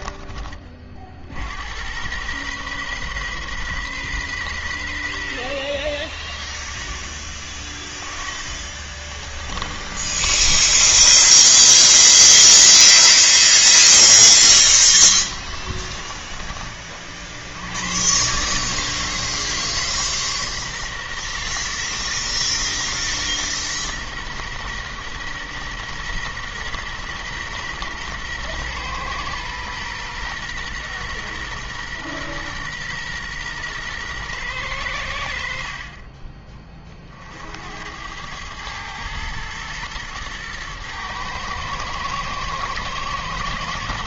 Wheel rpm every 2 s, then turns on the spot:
50, 130, 110, 40, 30, 20, 0, 20, 40, 140, 130, 120, 120, 120, 120, 120, 120, 100, 40, 110, 110, 120.
8-12 14-16